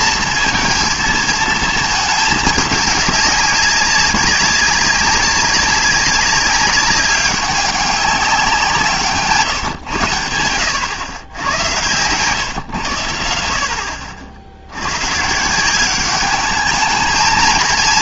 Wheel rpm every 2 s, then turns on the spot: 230, 210, 200, 200, 160, 110, 120, 70, 210.
none